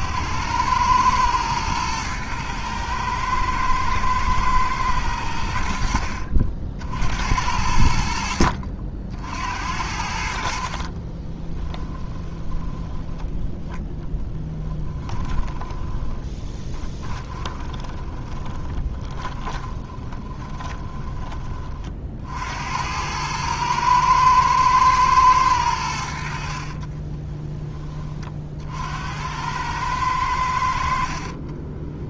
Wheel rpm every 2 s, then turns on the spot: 100, 110, 110, 70, 60, 40, 30, 10, 30, 20, 20, 80, 110, 50, 60, 70.
10-22 26-28